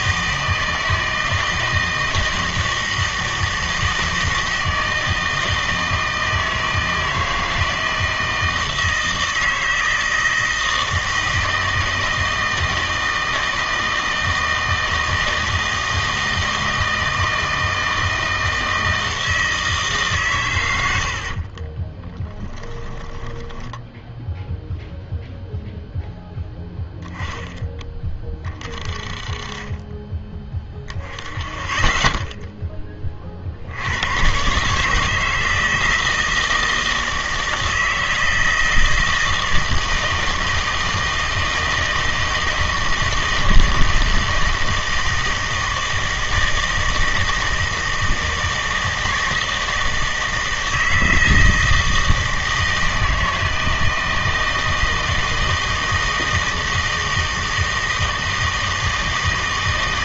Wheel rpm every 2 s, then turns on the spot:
160, 160, 160, 160, 160, 160, 160, 160, 160, 160, 100, 10, 0, 10, 30, 20, 10, 140, 160, 160, 160, 160, 160, 160, 160, 160, 160, 160, 160, 160.
22-24